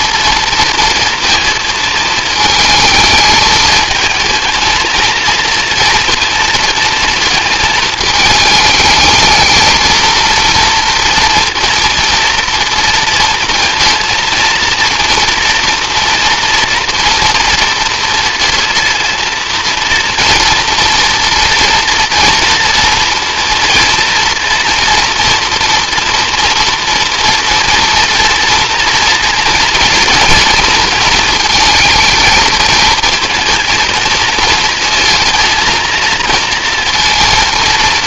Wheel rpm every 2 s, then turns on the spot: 230, 220, 230, 230, 220, 230, 230, 230, 240, 230, 230, 230, 230, 240, 230, 230, 220, 230, 230.
none